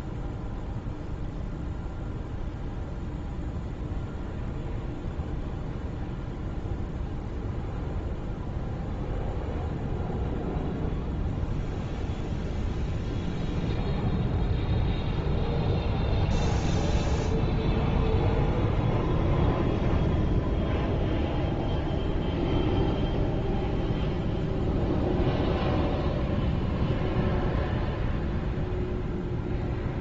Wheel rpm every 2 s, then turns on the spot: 0, 0, 0, 0, 0, 0, 0, 0, 0, 0, 0, 0, 0, 0, 0.
none